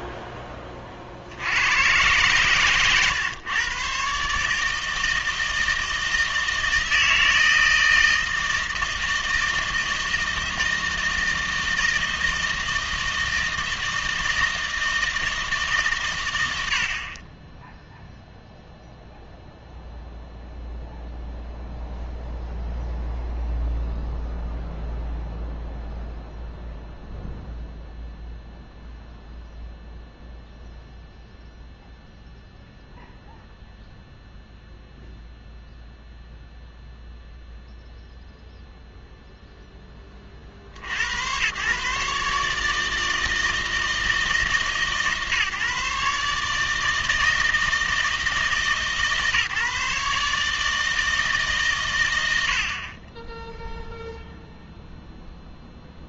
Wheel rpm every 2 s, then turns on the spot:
20, 120, 160, 160, 160, 160, 160, 160, 80, 0, 0, 0, 0, 0, 0, 0, 0, 0, 0, 0, 70, 150, 150, 150, 150, 160, 50, 0.
52-54